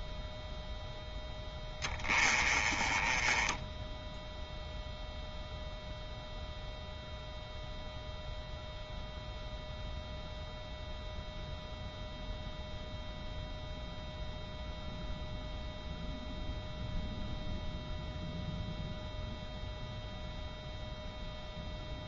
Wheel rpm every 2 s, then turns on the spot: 0, 20, 0, 0, 0, 0, 0, 0, 0, 0, 0.
none